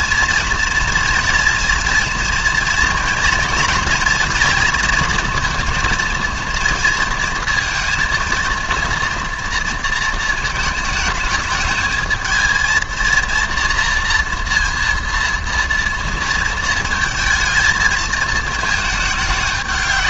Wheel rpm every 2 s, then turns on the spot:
230, 230, 230, 230, 230, 220, 220, 230, 230, 220.
none